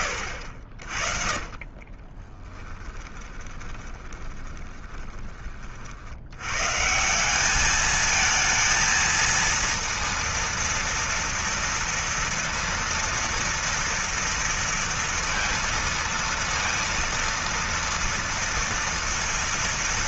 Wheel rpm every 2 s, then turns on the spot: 60, 20, 20, 150, 230, 230, 230, 230, 230, 230.
2-6